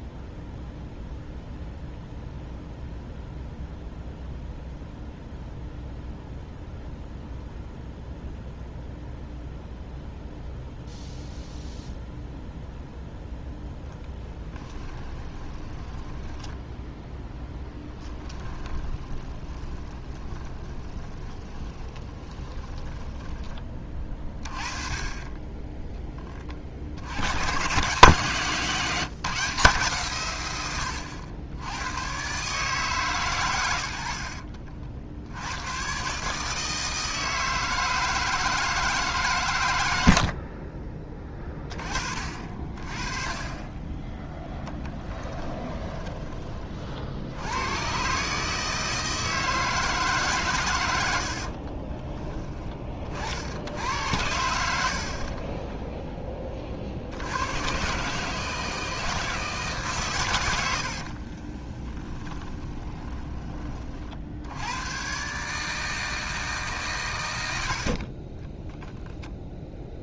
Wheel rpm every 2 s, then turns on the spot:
0, 0, 0, 0, 0, 0, 0, 10, 0, 20, 20, 20, 40, 40, 160, 100, 140, 50, 160, 160, 40, 40, 30, 40, 160, 100, 30, 70, 40, 160, 60, 10, 110, 140, 0.
14-16 18-24 40-42 44-46 60-64